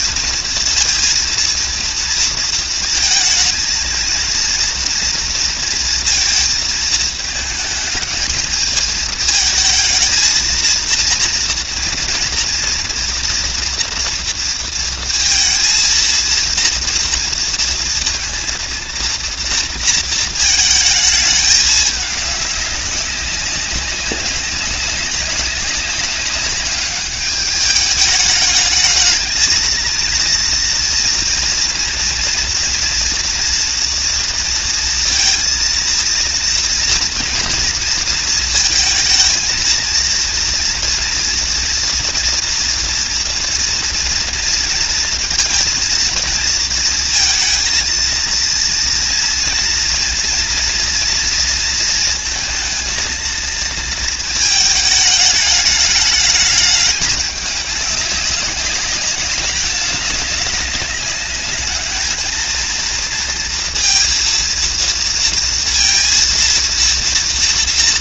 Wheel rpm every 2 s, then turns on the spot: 230, 230, 230, 220, 220, 230, 230, 230, 230, 230, 220, 190, 200, 200, 220, 230, 230, 230, 230, 230, 230, 230, 230, 230, 230, 230, 230, 210, 200, 200, 200, 230, 230, 230.
none